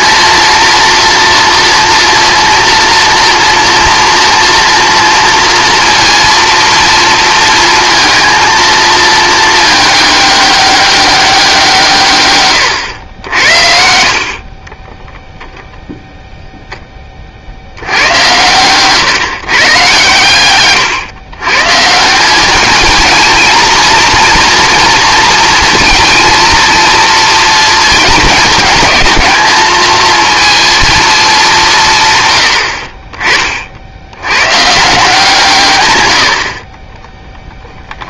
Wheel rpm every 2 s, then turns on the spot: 230, 240, 230, 230, 230, 200, 100, 20, 10, 130, 130, 220, 230, 230, 210, 230, 50, 150, 20.
14-16